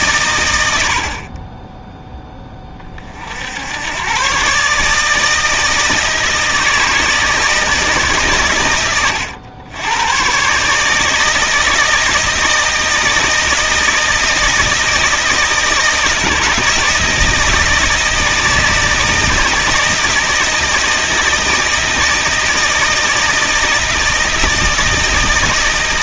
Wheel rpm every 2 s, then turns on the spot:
80, 20, 140, 160, 110, 140, 160, 160, 160, 160, 160, 160, 160.
none